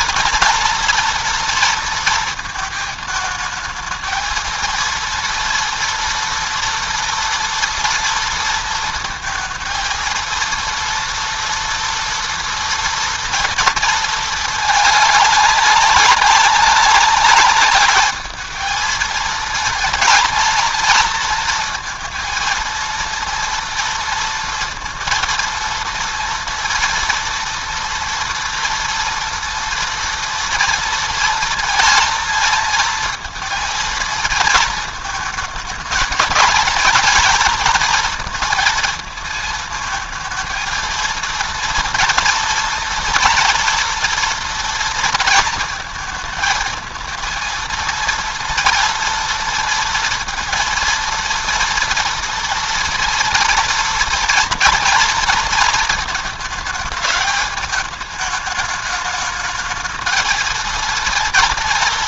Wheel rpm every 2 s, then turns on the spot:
230, 220, 230, 240, 230, 230, 230, 210, 200, 220, 230, 230, 230, 230, 230, 230, 220, 230, 230, 230, 230, 230, 230, 230, 230, 230, 230, 230, 220, 210, 230.
none